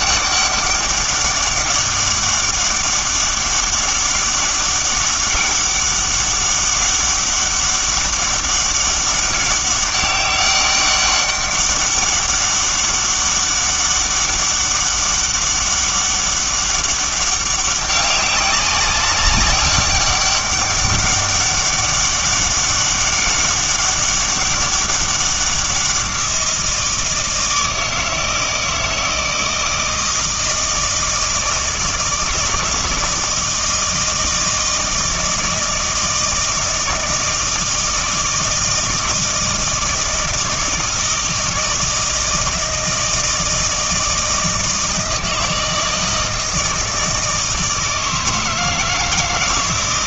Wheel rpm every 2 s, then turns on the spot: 200, 200, 200, 200, 200, 200, 200, 200, 200, 200, 200, 200, 200, 170, 160, 160, 160, 160, 160, 160, 160, 160, 160, 160, 160.
none